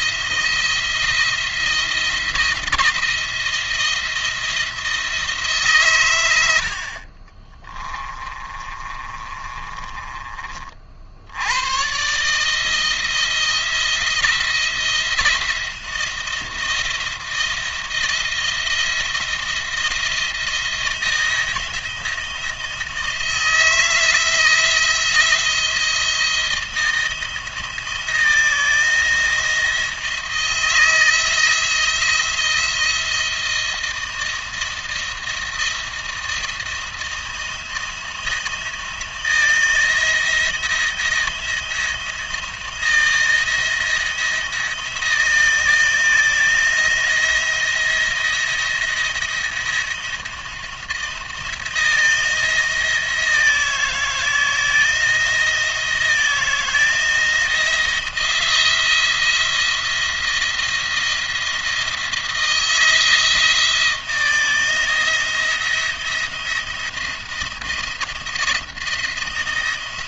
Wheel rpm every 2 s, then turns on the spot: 170, 170, 170, 70, 30, 40, 160, 170, 170, 170, 170, 170, 170, 170, 160, 170, 170, 170, 170, 170, 160, 170, 170, 160, 170, 170, 170, 160, 160, 170, 170, 160, 170, 170, 170.
8-10